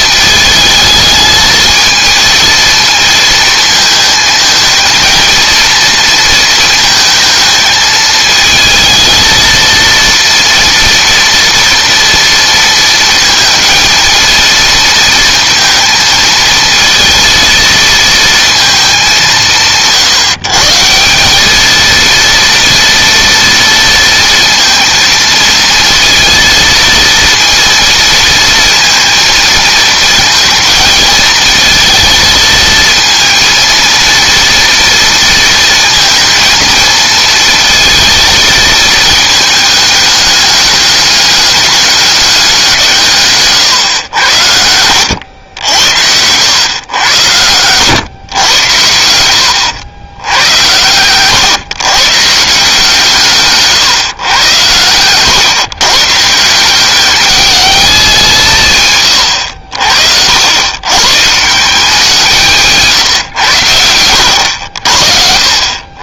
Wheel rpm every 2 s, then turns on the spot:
220, 230, 220, 220, 220, 230, 230, 230, 230, 220, 160, 230, 230, 230, 230, 220, 230, 230, 220, 220, 210, 170, 90, 110, 80, 100, 160, 110, 190, 150, 110, 150, 60.
58-60 62-64